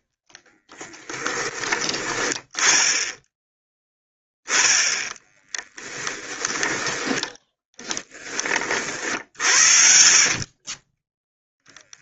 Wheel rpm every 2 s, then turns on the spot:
20, 10, 10, 10, 40, 20.
0-2